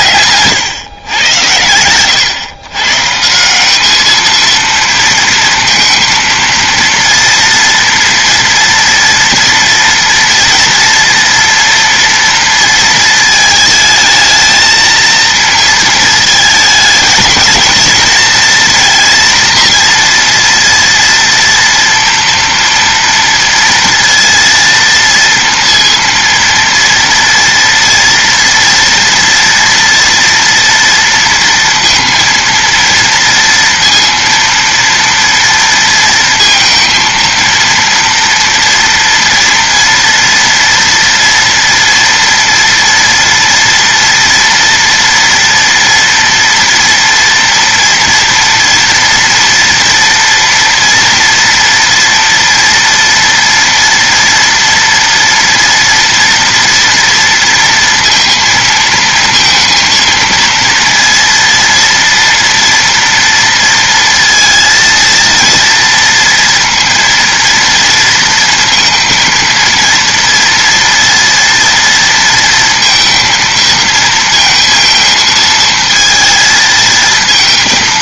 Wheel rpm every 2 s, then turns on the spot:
120, 140, 230, 230, 230, 240, 230, 230, 220, 240, 230, 230, 230, 230, 230, 230, 230, 230, 230, 230, 230, 230, 240, 240, 230, 230, 230, 230, 230, 230, 230, 230, 230, 230, 230, 230, 230, 230, 220.
none